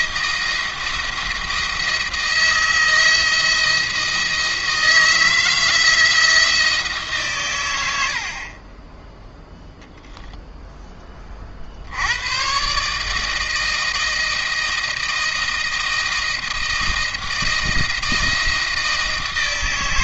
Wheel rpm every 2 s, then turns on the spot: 170, 170, 170, 150, 20, 20, 140, 160, 160, 160.
none